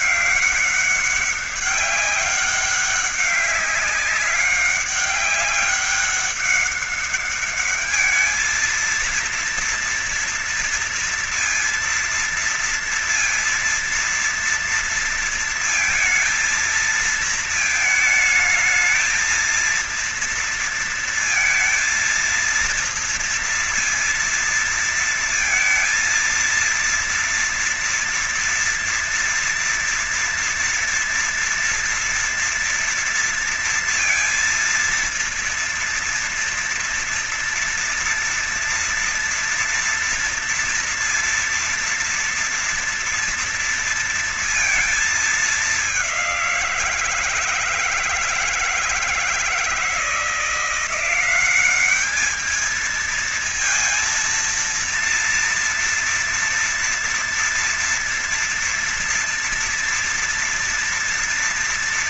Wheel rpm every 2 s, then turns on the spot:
200, 200, 190, 200, 210, 230, 230, 230, 230, 220, 230, 230, 230, 230, 230, 230, 230, 230, 230, 240, 230, 240, 230, 190, 160, 160, 210, 230, 230, 230, 240.
none